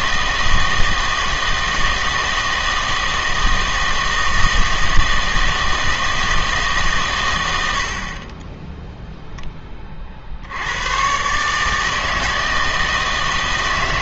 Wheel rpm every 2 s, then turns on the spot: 160, 160, 160, 150, 10, 90, 160.
none